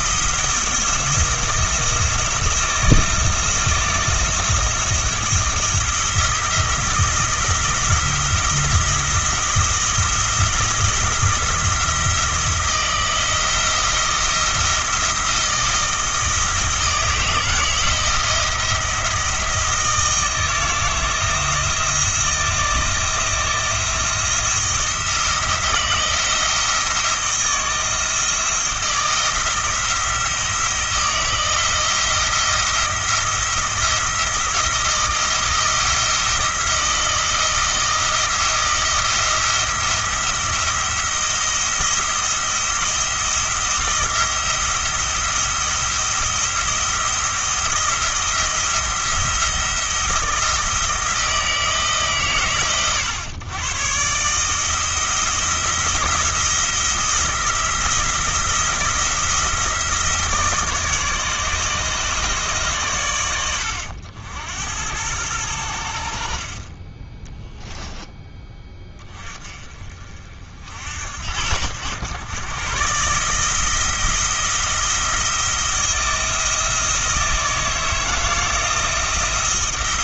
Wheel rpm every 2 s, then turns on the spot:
170, 170, 170, 170, 170, 170, 170, 160, 160, 170, 160, 170, 170, 160, 160, 170, 170, 170, 170, 170, 170, 170, 170, 170, 170, 160, 110, 160, 170, 170, 160, 130, 90, 30, 20, 60, 130, 170, 160, 160.
none